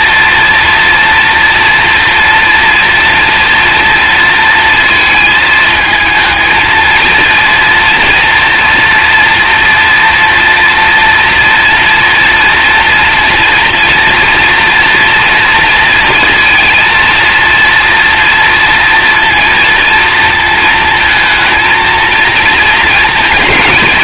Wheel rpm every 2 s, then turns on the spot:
230, 230, 230, 230, 230, 230, 230, 240, 230, 230, 220, 230.
none